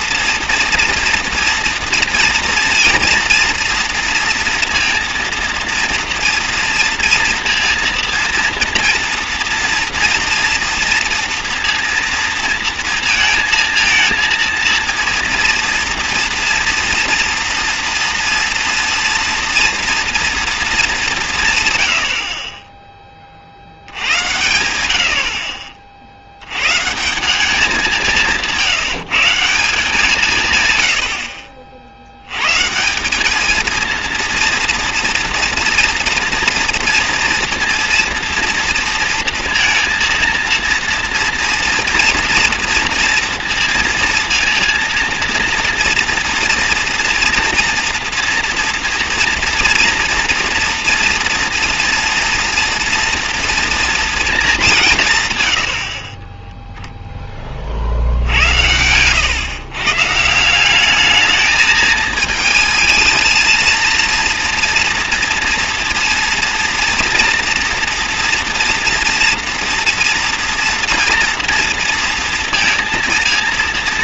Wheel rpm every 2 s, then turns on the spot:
230, 230, 230, 230, 230, 230, 230, 230, 230, 230, 220, 30, 90, 110, 160, 130, 130, 230, 230, 230, 230, 230, 230, 230, 230, 240, 230, 200, 0, 90, 180, 220, 230, 240, 230, 230, 230.
none